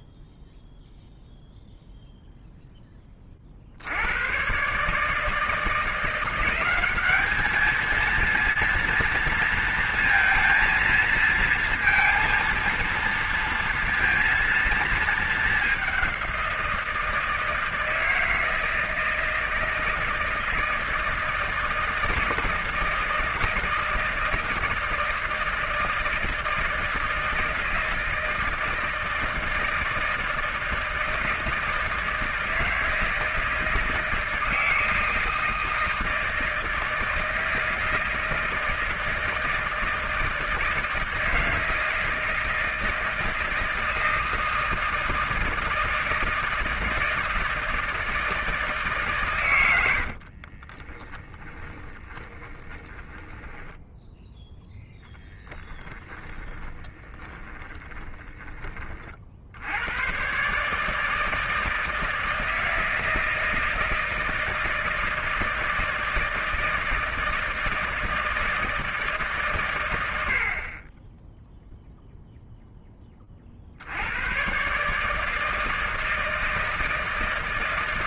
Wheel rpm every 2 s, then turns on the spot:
0, 10, 130, 190, 230, 230, 230, 230, 170, 160, 160, 160, 160, 160, 160, 160, 160, 160, 160, 160, 160, 160, 160, 160, 160, 30, 10, 0, 20, 20, 140, 160, 160, 160, 160, 40, 10, 130, 160.
50-54 56-58